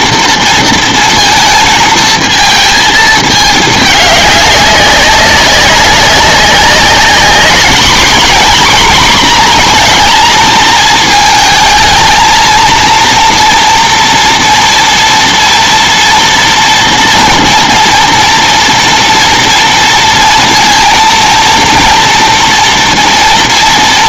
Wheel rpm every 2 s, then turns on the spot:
230, 220, 200, 200, 240, 220, 230, 230, 230, 230, 230, 230.
none